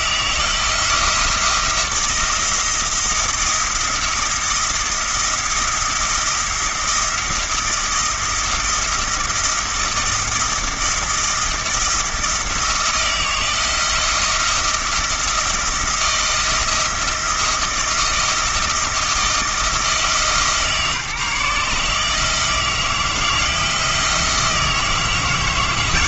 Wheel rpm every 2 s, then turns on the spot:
170, 170, 170, 170, 170, 170, 170, 170, 170, 160, 150, 160, 170.
none